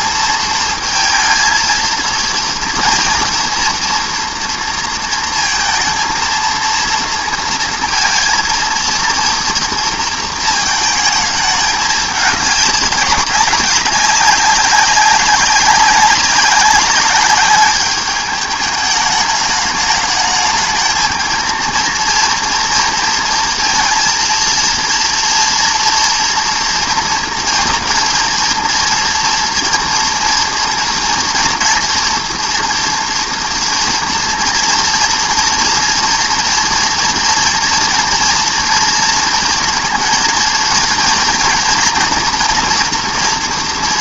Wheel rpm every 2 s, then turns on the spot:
230, 230, 230, 230, 230, 220, 200, 200, 200, 210, 210, 230, 230, 240, 230, 230, 240, 230, 230, 230, 230, 240.
none